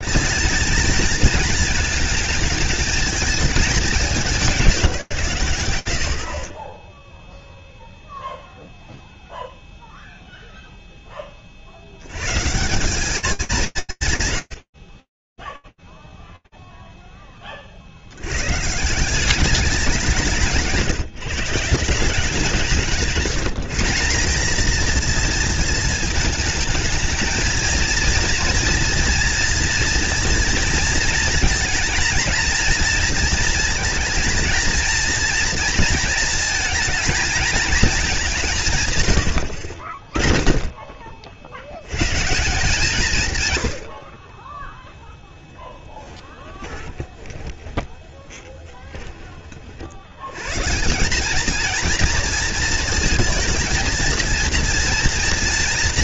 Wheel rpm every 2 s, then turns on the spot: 230, 220, 150, 10, 0, 30, 210, 50, 0, 130, 160, 170, 220, 210, 230, 230, 230, 230, 220, 160, 20, 170, 10, 20, 50, 220, 220, 240.
20-22 44-48